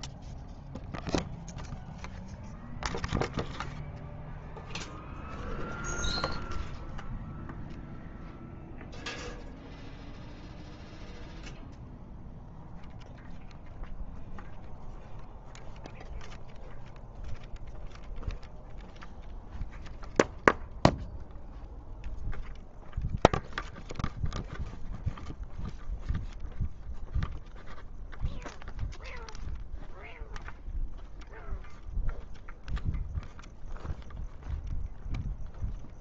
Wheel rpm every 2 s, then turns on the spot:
0, 0, 0, 0, 0, 0, 0, 0, 0, 0, 0, 0, 0, 0, 0, 0, 0, 0.
none